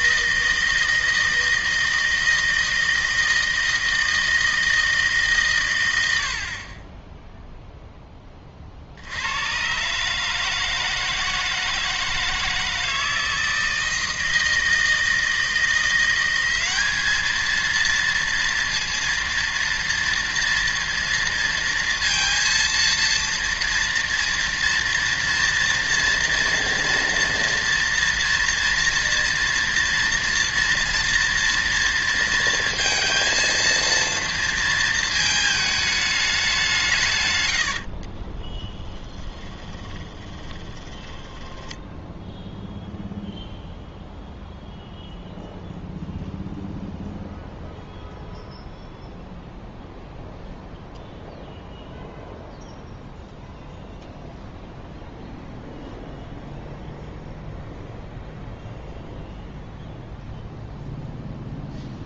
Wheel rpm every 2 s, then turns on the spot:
160, 160, 160, 30, 50, 160, 160, 160, 200, 230, 230, 230, 230, 230, 230, 230, 230, 230, 180, 10, 20, 0, 0, 0, 0, 0, 0, 0, 0, 0, 0.
38-42